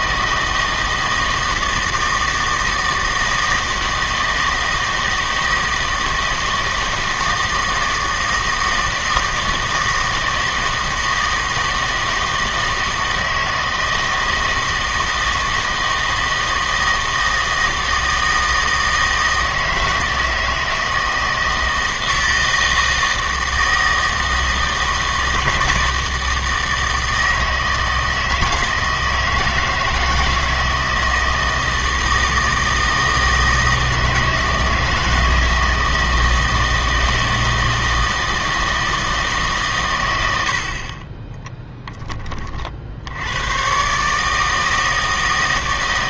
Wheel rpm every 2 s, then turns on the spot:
160, 160, 160, 160, 160, 160, 160, 160, 160, 160, 160, 160, 160, 160, 160, 160, 160, 160, 160, 160, 60, 50, 160.
none